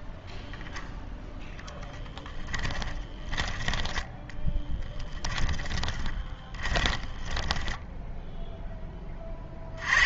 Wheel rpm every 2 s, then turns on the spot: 0, 10, 10, 20, 10.
2-8